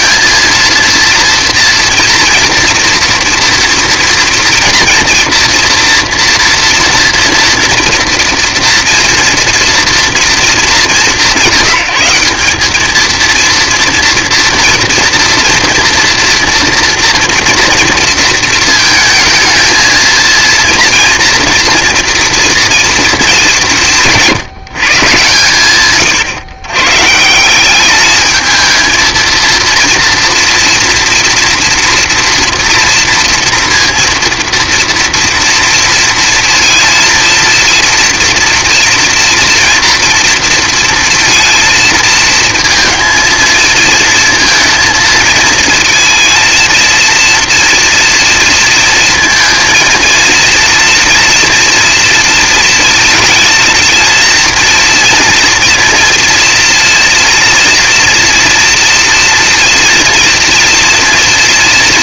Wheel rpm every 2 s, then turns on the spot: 230, 230, 230, 230, 230, 180, 220, 230, 240, 220, 230, 230, 160, 130, 220, 240, 230, 230, 230, 240, 230, 230, 230, 230, 230, 230, 230, 240, 240, 240, 230.
none